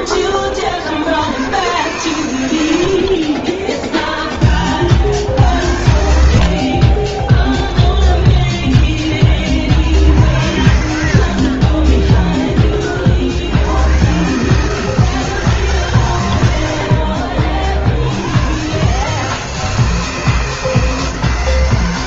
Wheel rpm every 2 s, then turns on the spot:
60, 90, 50, 60, 30, 80, 30, 150, 80, 130, 160.
6-10